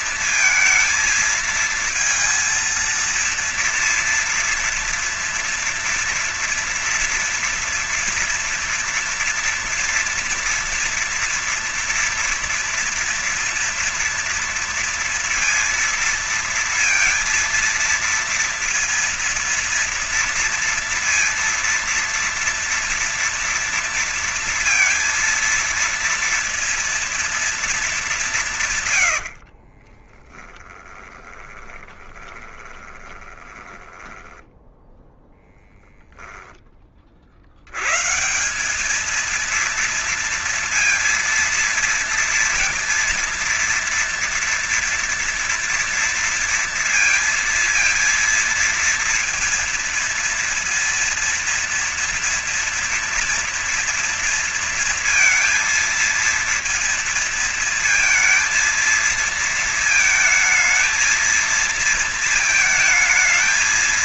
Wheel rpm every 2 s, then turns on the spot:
230, 230, 230, 230, 240, 230, 230, 230, 230, 230, 230, 230, 230, 230, 170, 10, 20, 10, 10, 160, 230, 230, 230, 230, 230, 230, 230, 230, 230, 220, 220, 220.
30-36